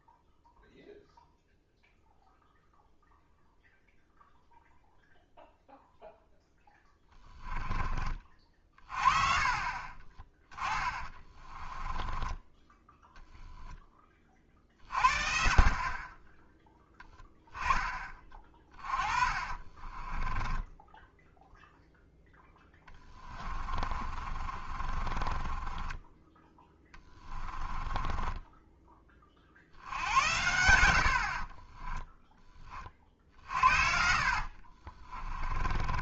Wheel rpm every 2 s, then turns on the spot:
0, 0, 0, 10, 40, 20, 10, 40, 10, 30, 10, 20, 40, 30, 20, 70, 30, 40.
6-12 18-28 34-36